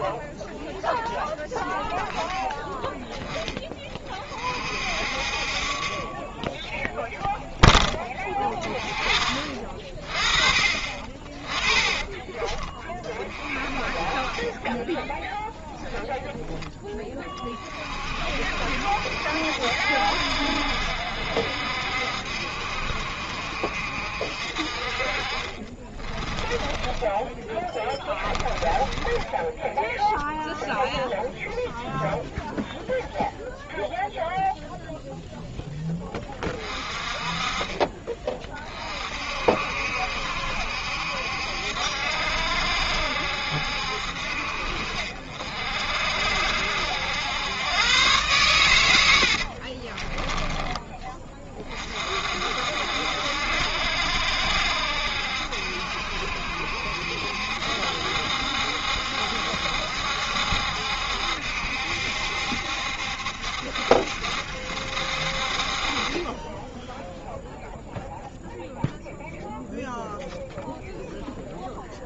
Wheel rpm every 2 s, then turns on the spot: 0, 10, 50, 0, 20, 40, 30, 20, 10, 60, 60, 60, 50, 20, 20, 0, 0, 0, 30, 30, 70, 70, 50, 70, 100, 20, 60, 70, 70, 70, 70, 70, 70, 10, 0, 0.
14-16 26-30